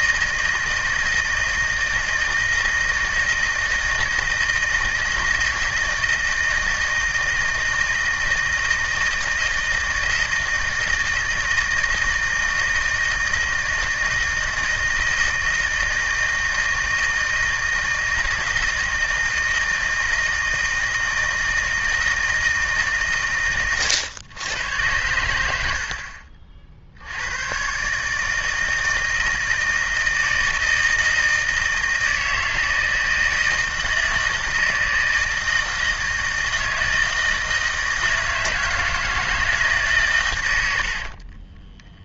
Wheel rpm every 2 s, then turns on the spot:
160, 160, 160, 160, 160, 160, 160, 160, 160, 160, 160, 150, 110, 60, 160, 160, 160, 160, 160, 160, 90.
40-42